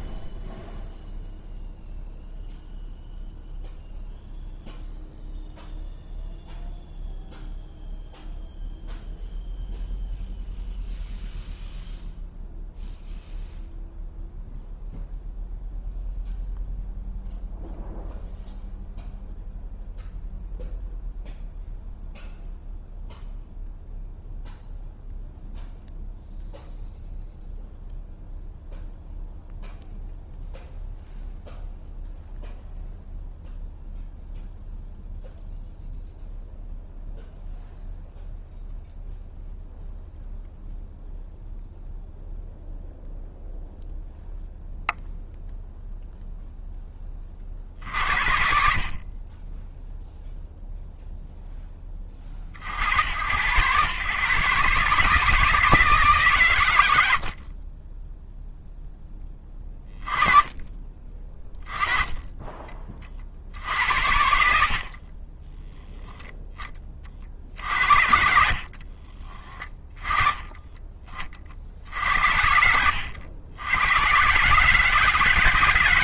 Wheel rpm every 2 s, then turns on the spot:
0, 0, 0, 0, 0, 0, 0, 0, 0, 0, 0, 0, 0, 0, 0, 0, 0, 0, 0, 0, 0, 0, 0, 0, 60, 0, 50, 130, 120, 0, 20, 20, 70, 10, 60, 10, 70, 130.
64-66 68-70